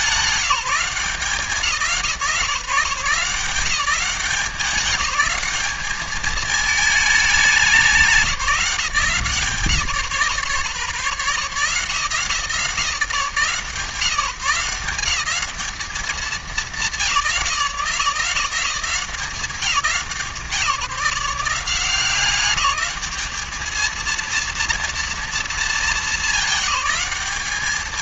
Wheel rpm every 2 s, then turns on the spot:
170, 160, 200, 210, 170, 120, 160, 180, 180, 170, 150, 210, 230, 190.
none